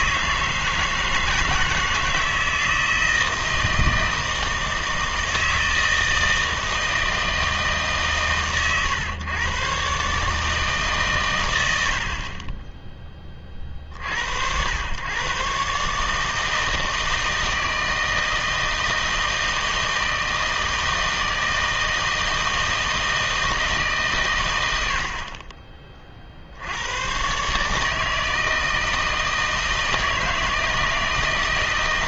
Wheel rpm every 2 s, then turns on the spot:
160, 160, 160, 160, 130, 150, 20, 90, 160, 160, 160, 160, 90, 80, 160, 160.
none